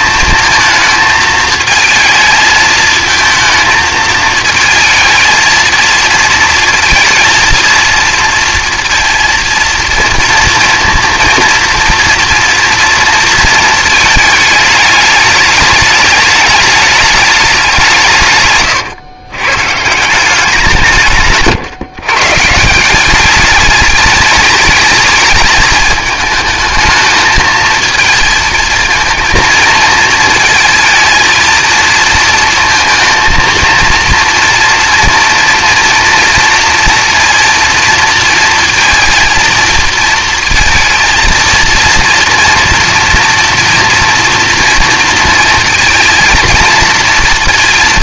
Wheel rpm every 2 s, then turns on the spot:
220, 220, 220, 230, 230, 230, 230, 210, 210, 130, 160, 170, 210, 220, 230, 220, 230, 230, 240, 230, 230, 230, 230, 230.
none